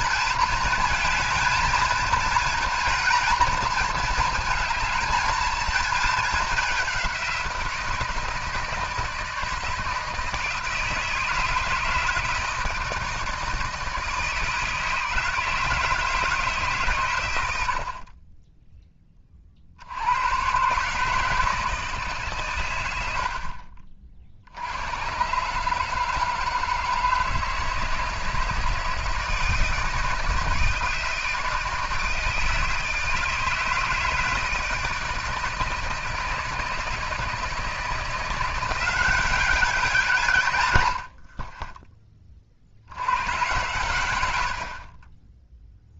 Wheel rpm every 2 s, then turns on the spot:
230, 230, 230, 210, 160, 160, 160, 160, 150, 20, 120, 120, 70, 150, 160, 160, 160, 160, 160, 170, 110, 50, 70.
none